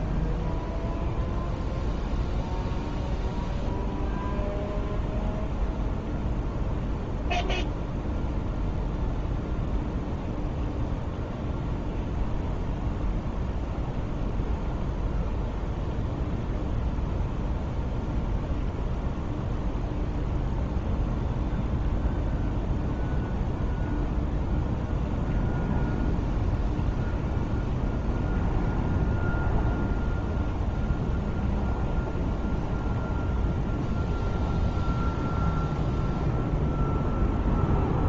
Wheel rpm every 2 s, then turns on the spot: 0, 0, 0, 0, 0, 0, 0, 0, 0, 0, 0, 0, 0, 0, 0, 0, 0, 0, 0.
none